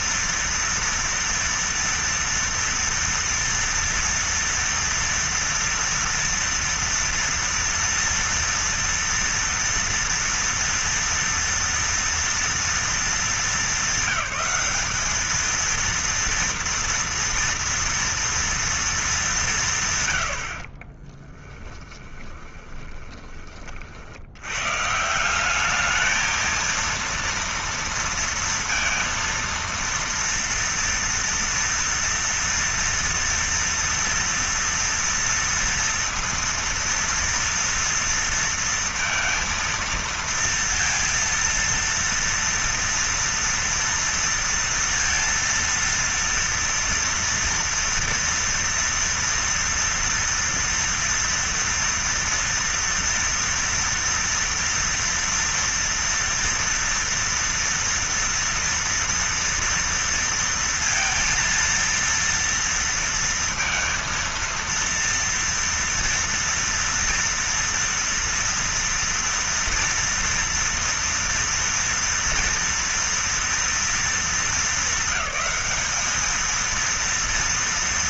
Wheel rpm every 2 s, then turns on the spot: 230, 230, 230, 230, 230, 230, 220, 200, 230, 230, 50, 20, 130, 230, 230, 230, 230, 240, 230, 230, 230, 230, 230, 230, 230, 230, 230, 230, 230, 230, 230, 230, 230, 230, 230, 230, 230, 200, 230.
20-24